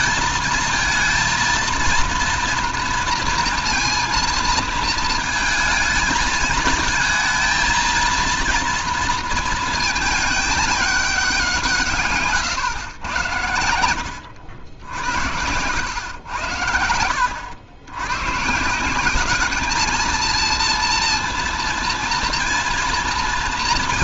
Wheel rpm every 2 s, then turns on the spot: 220, 230, 220, 220, 240, 210, 120, 80, 90, 150, 230, 230.
none